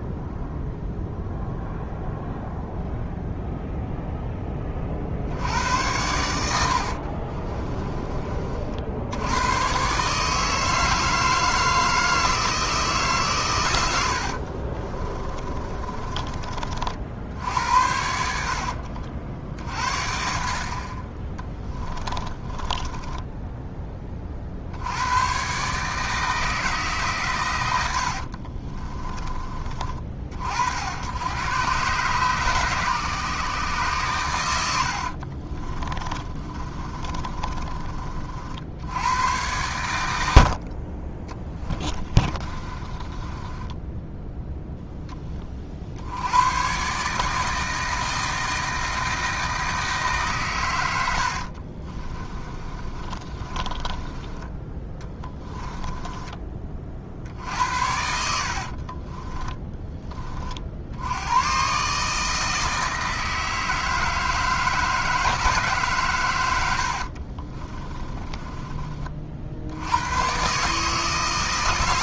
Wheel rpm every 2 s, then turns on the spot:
0, 0, 40, 60, 60, 160, 160, 30, 50, 60, 40, 20, 80, 150, 30, 70, 140, 80, 30, 70, 40, 30, 0, 130, 160, 100, 30, 20, 40, 40, 70, 160, 160, 90, 30, 150.
6-8 14-16 18-20 22-24 28-30 34-38 42-44 52-56 58-60 66-68